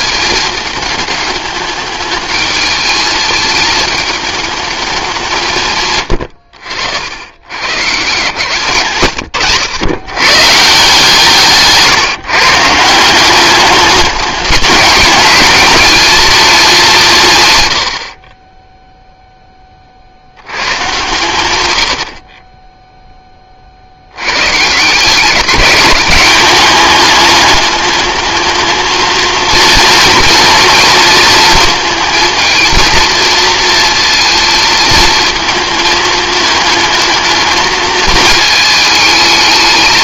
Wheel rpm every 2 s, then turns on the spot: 220, 210, 210, 80, 120, 150, 160, 200, 190, 0, 120, 10, 150, 200, 220, 230, 230, 230, 220, 220.
none